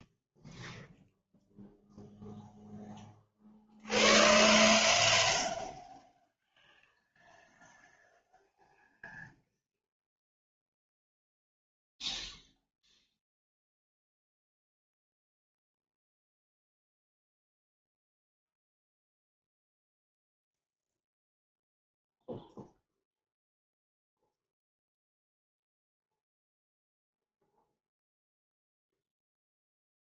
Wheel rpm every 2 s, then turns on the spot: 0, 0, 0, 0, 0, 0, 0, 0, 0, 0, 0, 0, 0, 0, 0.
none